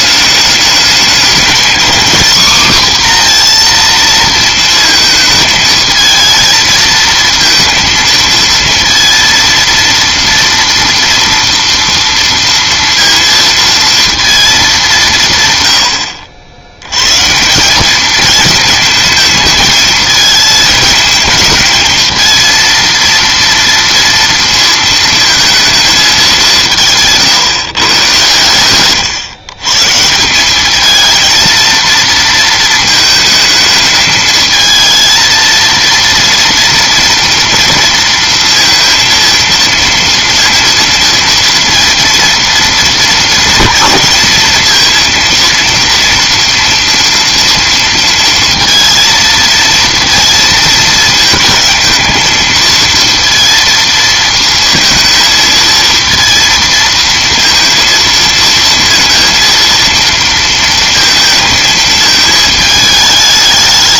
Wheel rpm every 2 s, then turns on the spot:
210, 250, 230, 220, 230, 230, 230, 210, 90, 220, 220, 230, 230, 180, 110, 200, 220, 220, 230, 230, 230, 230, 230, 230, 230, 220, 220, 230, 230, 230, 230, 220.
none